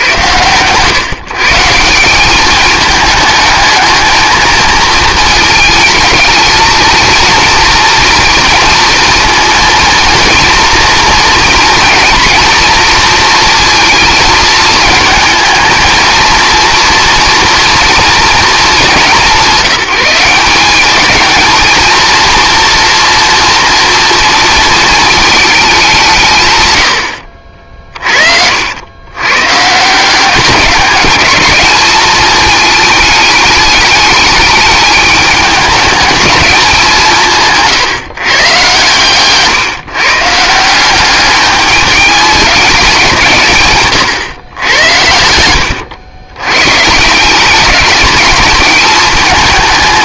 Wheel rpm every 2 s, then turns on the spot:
120, 210, 220, 220, 230, 240, 230, 220, 230, 210, 190, 240, 230, 120, 80, 190, 220, 210, 200, 130, 170, 200, 100, 120, 210.
none